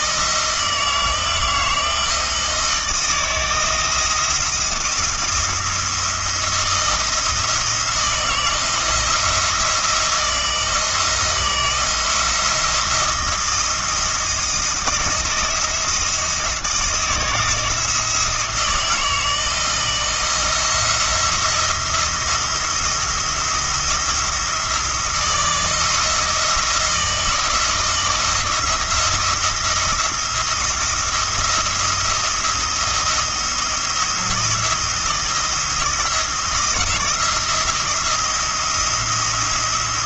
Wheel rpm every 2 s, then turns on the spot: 160, 160, 160, 170, 160, 170, 170, 160, 160, 160, 170, 170, 160, 160, 170, 170, 170, 170, 170, 170.
none